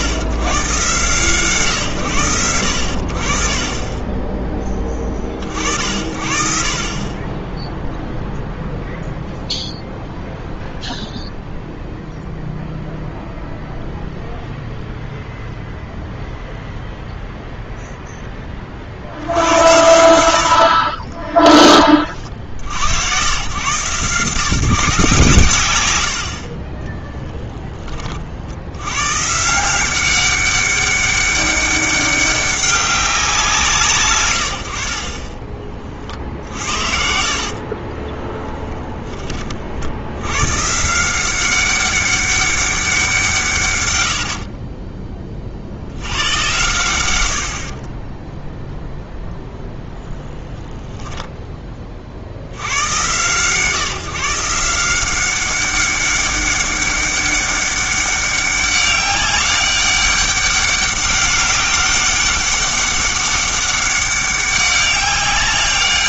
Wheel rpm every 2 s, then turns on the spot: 120, 80, 20, 40, 0, 0, 0, 0, 0, 40, 50, 80, 160, 30, 90, 200, 200, 80, 70, 10, 140, 190, 50, 100, 0, 10, 110, 170, 200, 190, 200, 200, 200.
20-22 44-46